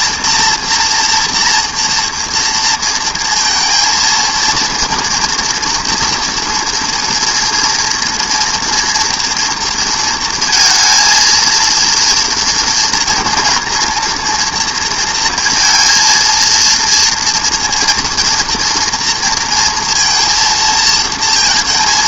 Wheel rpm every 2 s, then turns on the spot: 230, 230, 230, 230, 230, 230, 230, 230, 230, 240, 230.
none